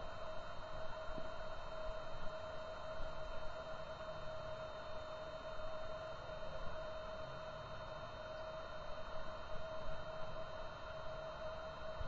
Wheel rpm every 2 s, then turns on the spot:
0, 0, 0, 0, 0, 0.
none